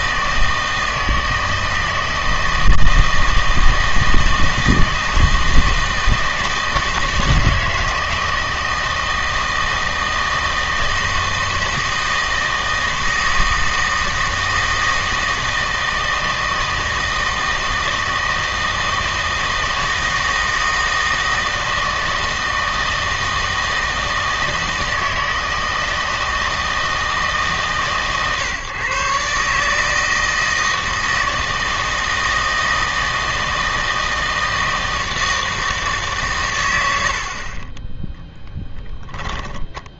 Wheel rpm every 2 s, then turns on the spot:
160, 160, 160, 160, 160, 160, 160, 160, 160, 160, 160, 160, 160, 160, 130, 160, 160, 160, 100, 10.
38-40